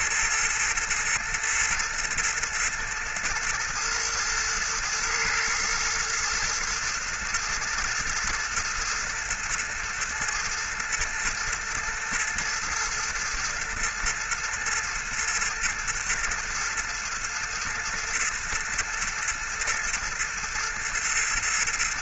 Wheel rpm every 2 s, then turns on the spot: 120, 120, 110, 110, 120, 120, 110, 120, 110, 110, 110.
none